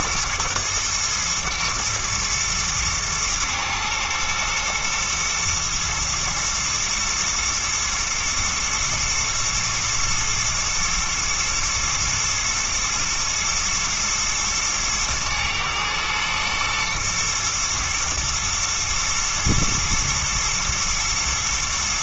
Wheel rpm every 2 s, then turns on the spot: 110, 110, 110, 110, 120, 110, 120, 110, 120, 110, 120.
none